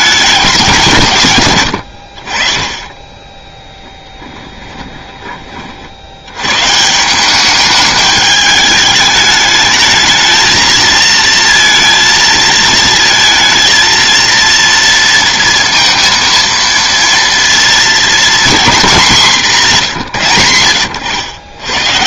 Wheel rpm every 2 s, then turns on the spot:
190, 30, 20, 140, 210, 220, 220, 230, 230, 230, 90.
4-6